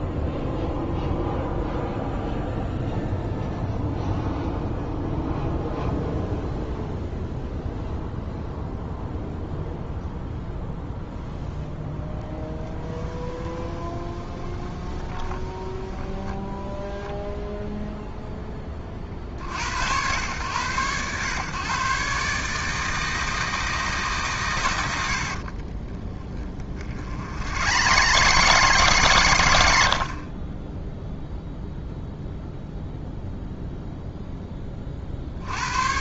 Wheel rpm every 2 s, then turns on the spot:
0, 0, 0, 0, 0, 0, 10, 20, 0, 20, 110, 160, 100, 60, 140, 20, 0, 30.
12-16 26-30